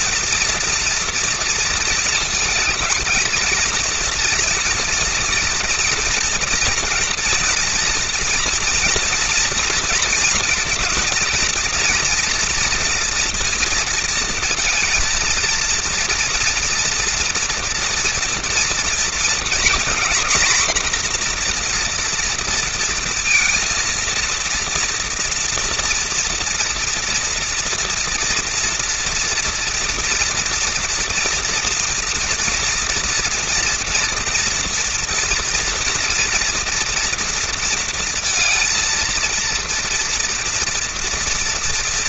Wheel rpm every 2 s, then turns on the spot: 240, 220, 230, 240, 230, 230, 240, 230, 230, 230, 240, 230, 230, 230, 230, 230, 230, 230, 230, 230, 230.
none